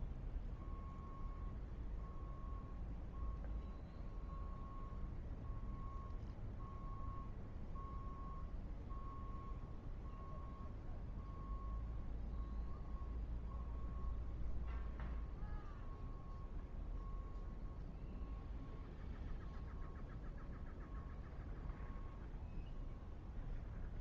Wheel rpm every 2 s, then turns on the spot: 0, 0, 0, 0, 0, 0, 0, 0, 0, 0, 0, 0.
none